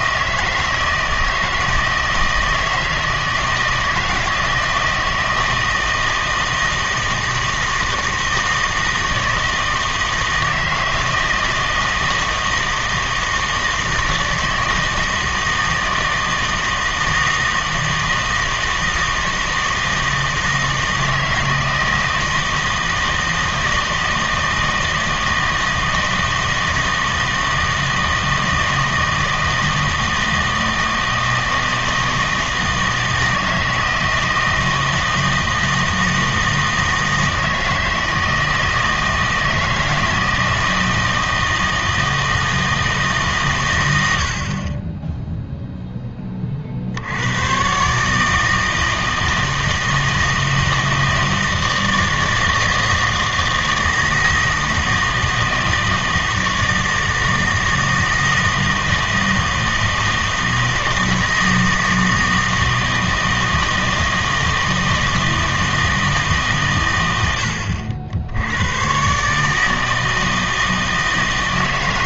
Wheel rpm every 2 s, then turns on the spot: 160, 160, 170, 160, 160, 160, 160, 160, 160, 160, 160, 160, 160, 160, 160, 160, 160, 160, 160, 160, 160, 160, 40, 40, 160, 160, 160, 160, 160, 160, 160, 160, 160, 140, 100, 160.
none